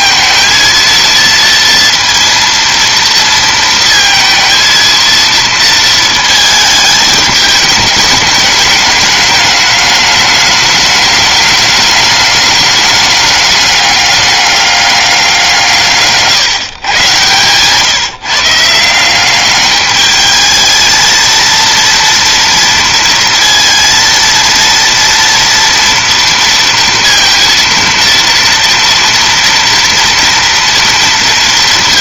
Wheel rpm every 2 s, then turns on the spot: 230, 230, 220, 220, 210, 210, 200, 200, 130, 160, 220, 230, 230, 230, 230, 230.
none